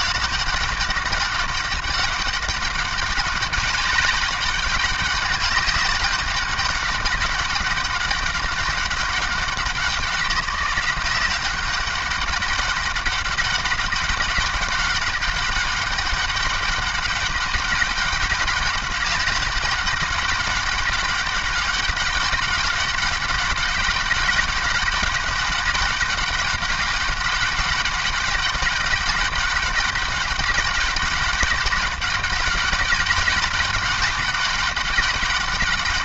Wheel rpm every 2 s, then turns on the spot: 200, 200, 200, 200, 200, 180, 200, 190, 200, 200, 200, 200, 200, 200, 200, 200, 200, 200.
none